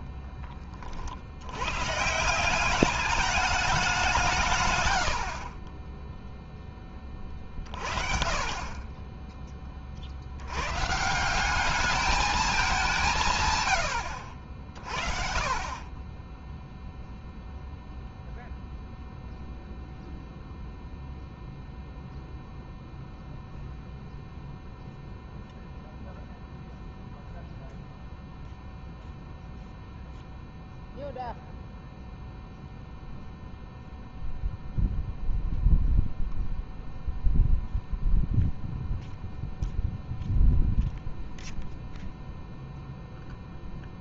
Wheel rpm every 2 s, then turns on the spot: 50, 200, 90, 20, 20, 150, 170, 40, 0, 0, 0, 0, 0, 0, 0, 0, 0, 0, 0, 0, 0, 0.
4-6